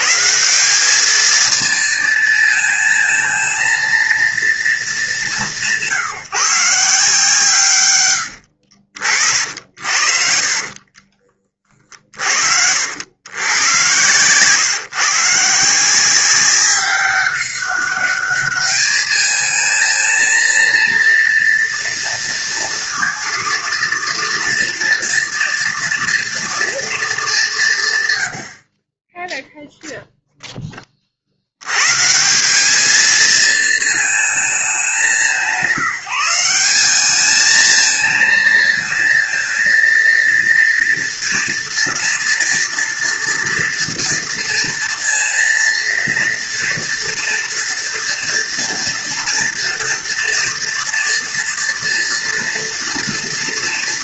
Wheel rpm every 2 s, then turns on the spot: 170, 230, 220, 150, 70, 50, 70, 130, 190, 210, 230, 230, 230, 230, 70, 10, 180, 200, 190, 230, 230, 230, 230, 230, 230, 230, 230.
8-12 28-30